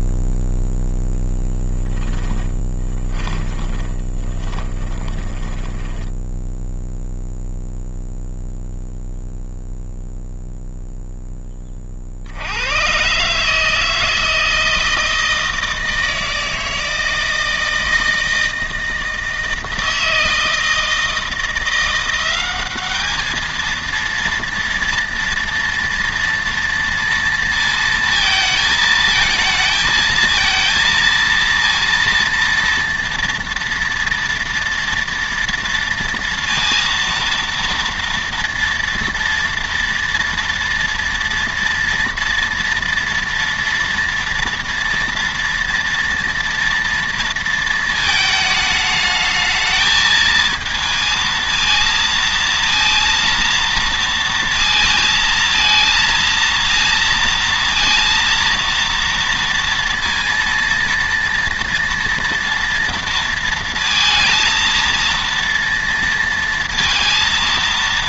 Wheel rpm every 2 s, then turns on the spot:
0, 20, 20, 0, 0, 0, 80, 160, 160, 160, 160, 200, 230, 230, 220, 230, 230, 230, 230, 230, 230, 240, 230, 230, 220, 220, 230, 220, 230, 230, 230, 230, 230, 230.
2-6